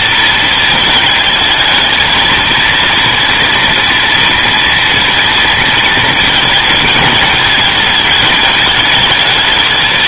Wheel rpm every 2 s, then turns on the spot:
220, 230, 230, 220, 210.
none